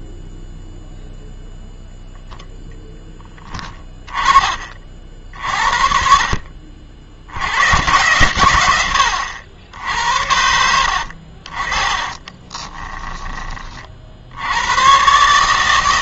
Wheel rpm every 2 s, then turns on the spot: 0, 10, 40, 50, 110, 90, 20, 100.
12-14